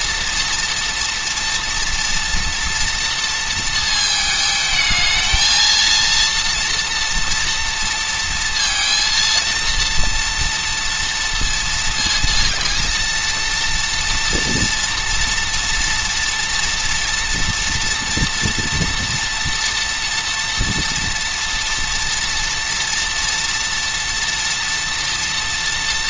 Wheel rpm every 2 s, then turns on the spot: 240, 230, 220, 230, 230, 230, 230, 230, 240, 230, 230, 240, 230.
none